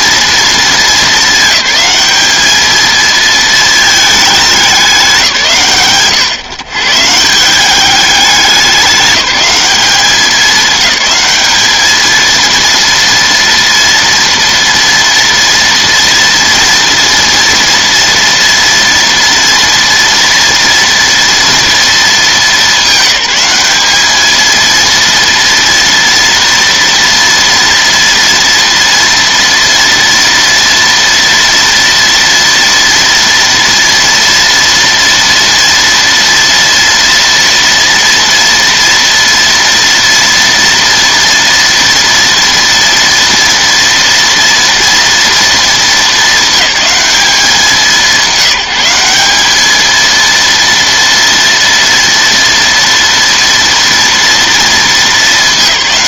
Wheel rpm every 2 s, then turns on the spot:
220, 220, 210, 130, 200, 210, 230, 230, 230, 230, 230, 200, 230, 230, 230, 230, 240, 230, 230, 230, 230, 230, 230, 210, 190, 230, 230, 230.
none